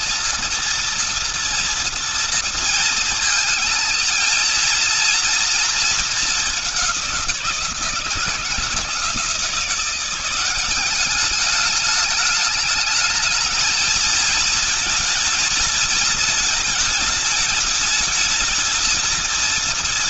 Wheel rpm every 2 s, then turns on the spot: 230, 230, 230, 190, 170, 200, 220, 220, 210, 220.
none